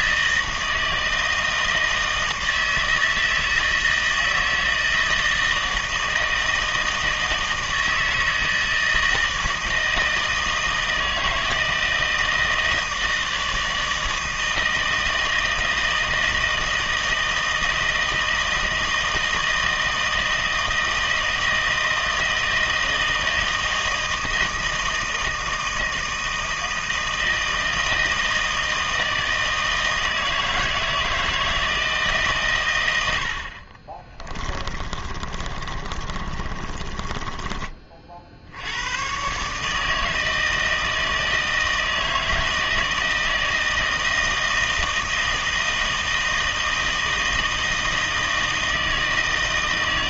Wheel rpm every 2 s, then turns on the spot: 160, 160, 160, 160, 160, 160, 160, 160, 160, 160, 160, 160, 160, 160, 160, 160, 110, 30, 30, 90, 160, 160, 160, 160, 160.
34-38